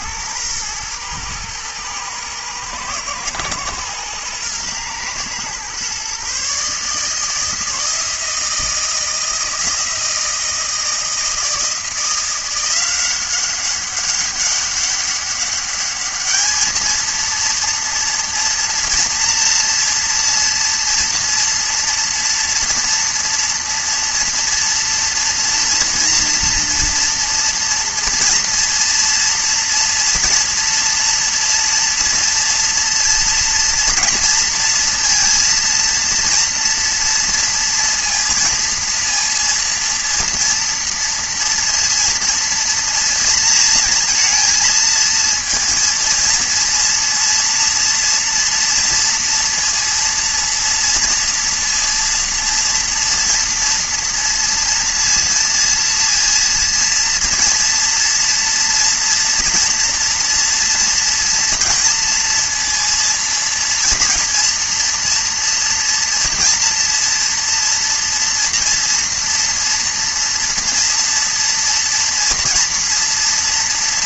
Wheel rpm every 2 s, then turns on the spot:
110, 120, 120, 150, 160, 160, 180, 200, 230, 230, 230, 230, 240, 230, 230, 230, 230, 230, 230, 230, 230, 230, 230, 230, 230, 230, 230, 230, 230, 230, 230, 230, 240, 230, 230, 240, 230.
none